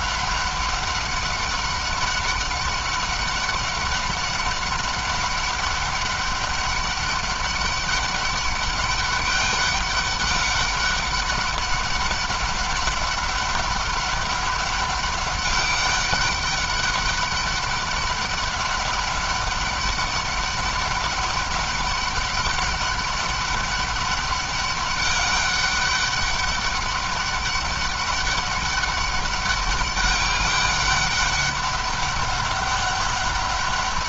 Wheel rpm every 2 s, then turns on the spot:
200, 200, 200, 200, 200, 200, 200, 200, 200, 200, 190, 200, 200, 200, 200, 200, 200.
none